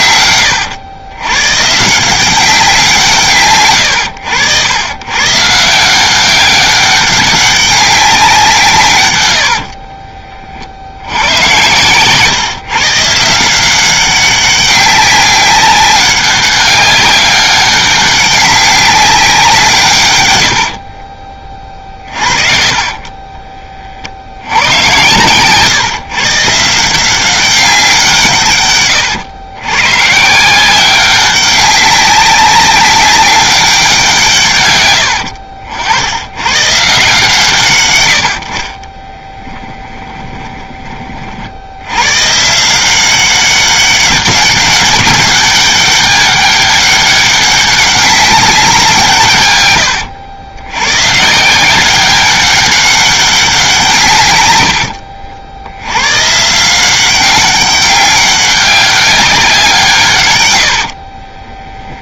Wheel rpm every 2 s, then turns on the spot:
90, 180, 120, 200, 160, 70, 150, 190, 200, 200, 60, 30, 120, 160, 120, 180, 200, 110, 130, 20, 30, 170, 190, 200, 180, 110, 200, 80, 170, 200, 80.
20-22 60-62